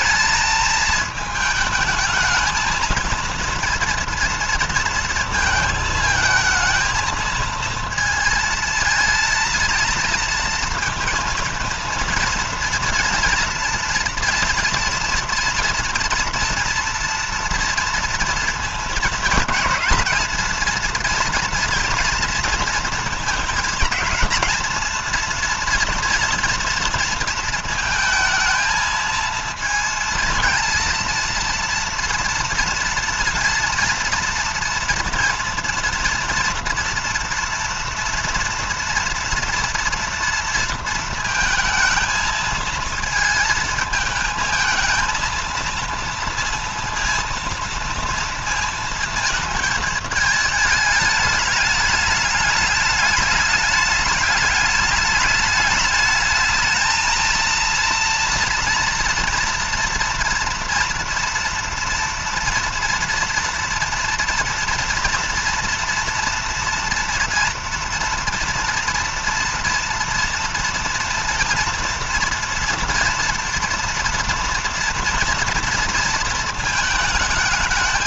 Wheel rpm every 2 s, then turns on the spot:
220, 220, 230, 220, 220, 220, 230, 230, 230, 230, 230, 220, 230, 230, 230, 230, 230, 230, 230, 230, 230, 220, 220, 230, 230, 210, 210, 210, 220, 230, 230, 230, 230, 230, 230, 230, 240, 230, 220.
none